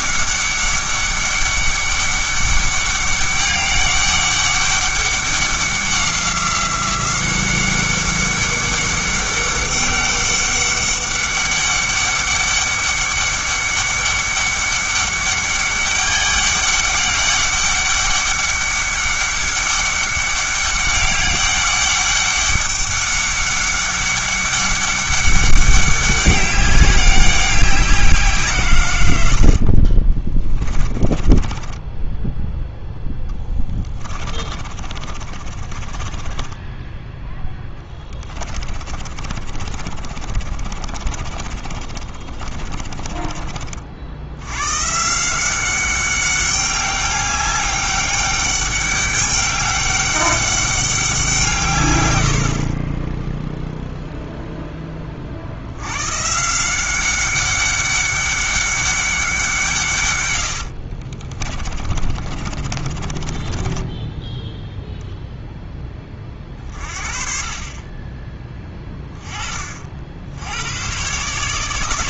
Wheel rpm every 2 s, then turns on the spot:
200, 200, 200, 190, 200, 200, 200, 200, 200, 200, 200, 200, 200, 190, 140, 20, 0, 30, 10, 20, 40, 40, 120, 200, 200, 200, 50, 10, 170, 200, 90, 40, 0, 30, 20, 100.
30-32 34-44 60-64